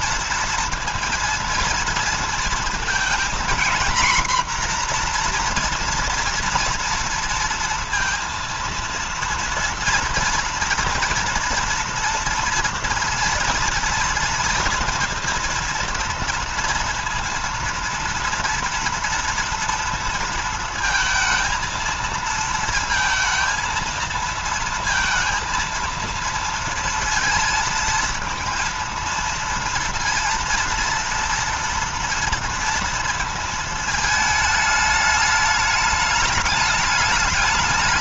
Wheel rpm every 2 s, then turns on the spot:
240, 230, 240, 230, 230, 230, 230, 230, 230, 230, 220, 230, 230, 230, 230, 230, 230, 220, 210.
none